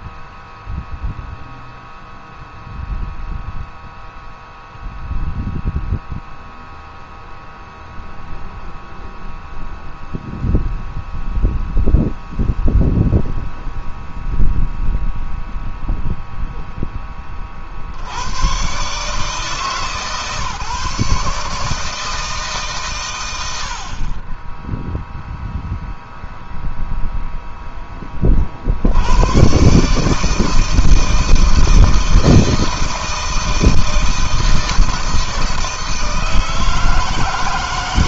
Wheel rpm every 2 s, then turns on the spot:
0, 0, 0, 0, 0, 0, 0, 0, 30, 140, 150, 110, 0, 0, 100, 160, 160, 160, 160.
none